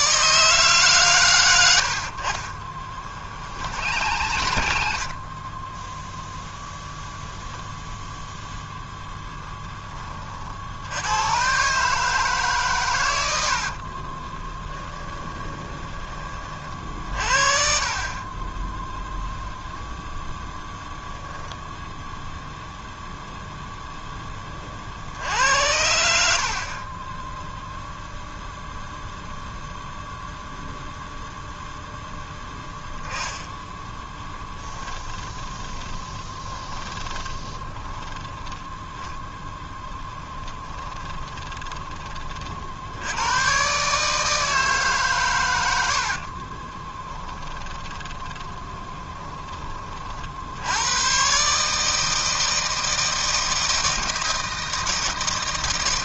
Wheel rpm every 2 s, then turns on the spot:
50, 80, 0, 0, 10, 140, 70, 20, 40, 0, 0, 0, 70, 10, 0, 0, 20, 30, 30, 10, 30, 90, 130, 20, 10, 120, 160, 160.
0-4 12-16 26-28 32-38 40-42 46-48